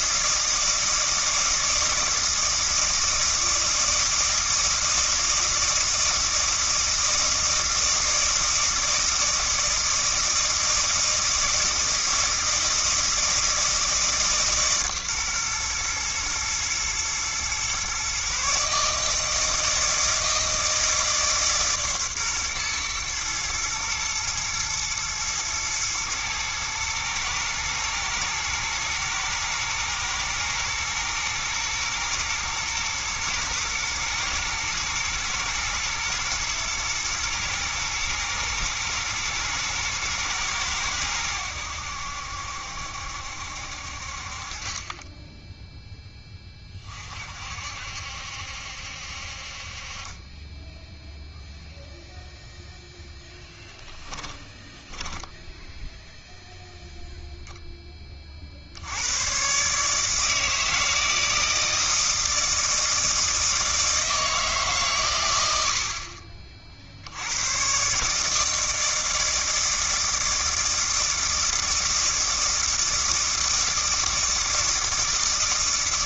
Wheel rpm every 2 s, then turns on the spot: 160, 160, 160, 160, 160, 160, 160, 140, 120, 150, 160, 120, 110, 110, 120, 120, 120, 120, 110, 110, 110, 70, 30, 20, 70, 10, 0, 30, 0, 60, 160, 160, 150, 40, 160, 160, 160, 160.
54-56